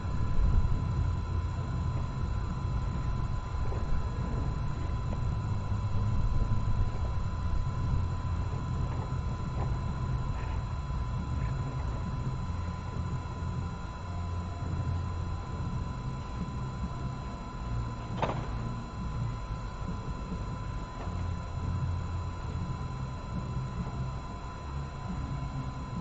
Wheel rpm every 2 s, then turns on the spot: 0, 0, 0, 0, 0, 0, 0, 0, 0, 0, 0, 0, 0.
none